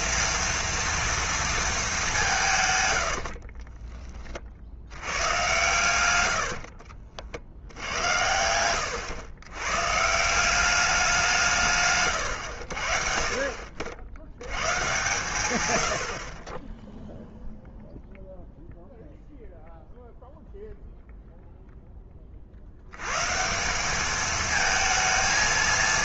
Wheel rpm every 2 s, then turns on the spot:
230, 170, 70, 50, 100, 190, 70, 110, 10, 0, 0, 70, 220.
6-8